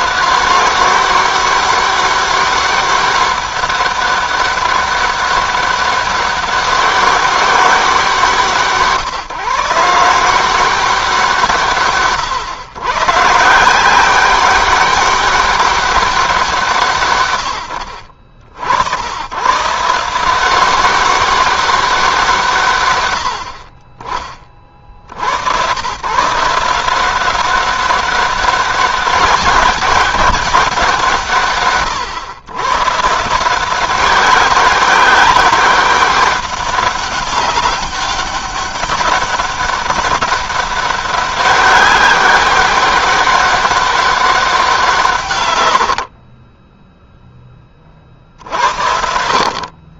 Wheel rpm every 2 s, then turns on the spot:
190, 200, 200, 190, 150, 180, 130, 200, 150, 90, 190, 100, 60, 180, 200, 170, 150, 200, 200, 190, 200, 200, 170, 10, 80.
none